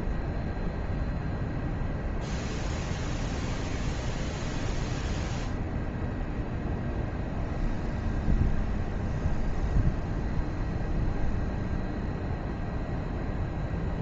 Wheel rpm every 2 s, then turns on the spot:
0, 0, 0, 0, 0, 0, 0.
none